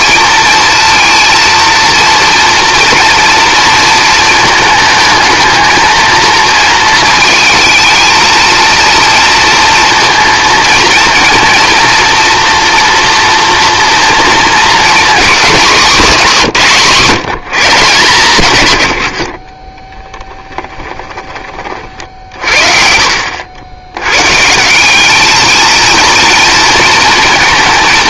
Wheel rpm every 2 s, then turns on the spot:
230, 230, 220, 220, 220, 230, 230, 240, 180, 110, 10, 50, 170, 230.
20-22